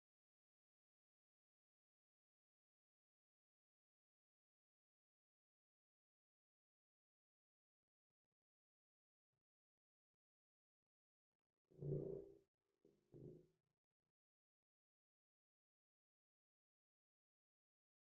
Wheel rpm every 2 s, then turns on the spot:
0, 0, 0, 0, 0, 0, 0, 0, 0.
none